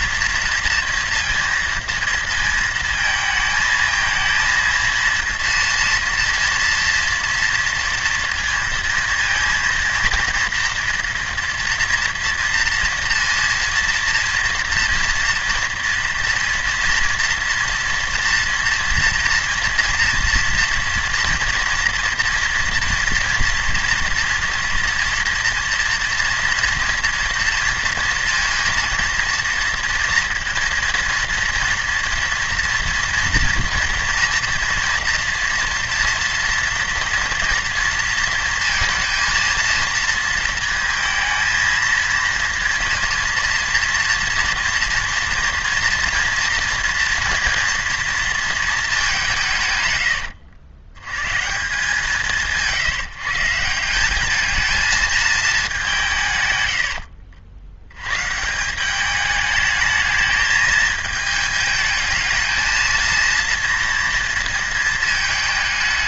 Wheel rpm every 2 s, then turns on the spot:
230, 230, 230, 230, 230, 230, 230, 230, 230, 230, 230, 230, 230, 230, 230, 230, 230, 240, 230, 230, 230, 230, 230, 230, 220, 90, 150, 210, 110, 170, 210, 230, 230.
none